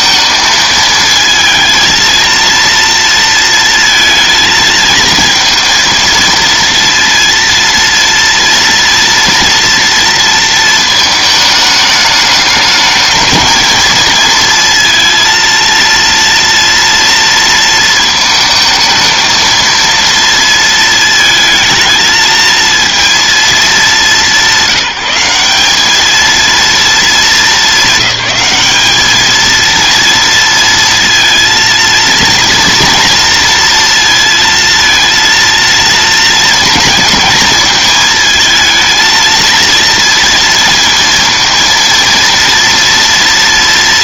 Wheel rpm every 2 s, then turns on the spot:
220, 230, 220, 230, 230, 220, 220, 230, 230, 220, 220, 230, 190, 220, 200, 230, 230, 230, 230, 220, 230, 230.
none